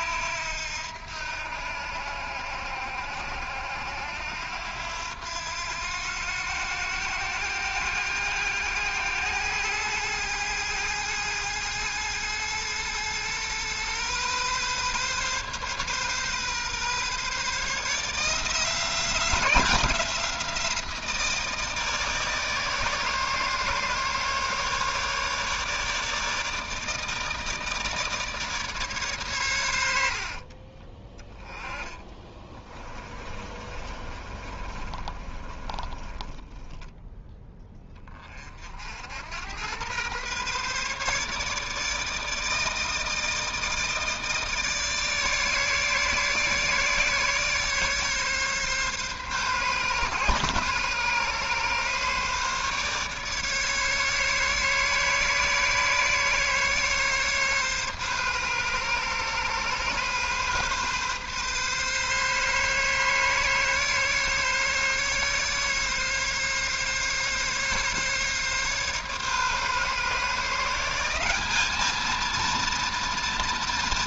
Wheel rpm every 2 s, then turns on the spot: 80, 80, 90, 100, 100, 110, 110, 130, 140, 170, 170, 150, 140, 160, 140, 30, 20, 20, 20, 60, 140, 160, 150, 150, 140, 130, 140, 140, 140, 130, 140, 140, 140, 140, 140, 170, 230.
30-38